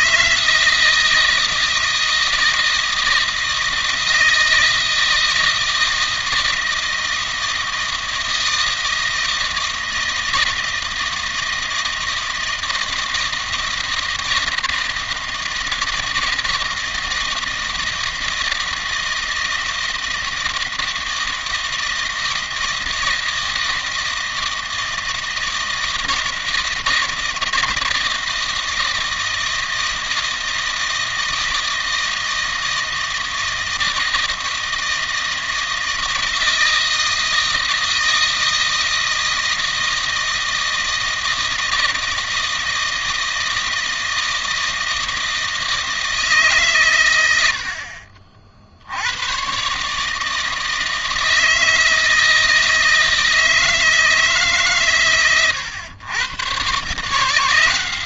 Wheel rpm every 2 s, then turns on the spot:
160, 160, 160, 160, 160, 160, 160, 160, 160, 160, 160, 160, 160, 160, 160, 160, 160, 160, 160, 160, 160, 160, 160, 120, 60, 160, 160, 140, 130.
none